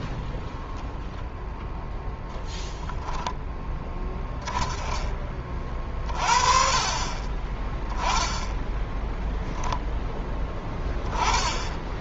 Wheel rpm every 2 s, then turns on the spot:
0, 0, 10, 30, 0, 20.
none